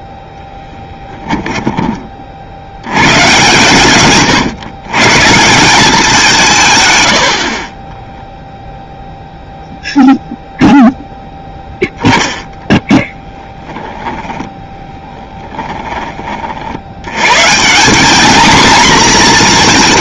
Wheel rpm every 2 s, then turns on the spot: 10, 70, 130, 140, 0, 0, 10, 10, 60, 230.
0-2 12-14